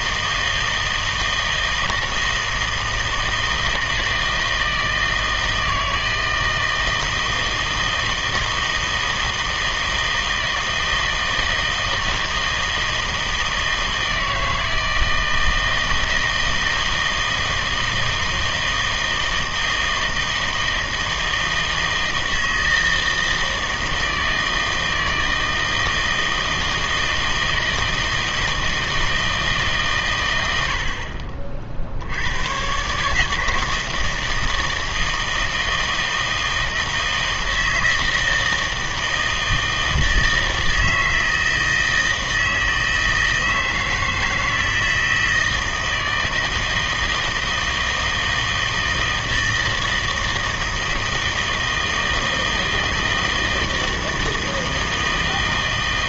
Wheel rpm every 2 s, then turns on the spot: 160, 160, 160, 160, 160, 160, 160, 160, 160, 160, 160, 160, 160, 160, 160, 80, 120, 160, 160, 160, 160, 160, 160, 160, 160, 160, 160, 160.
none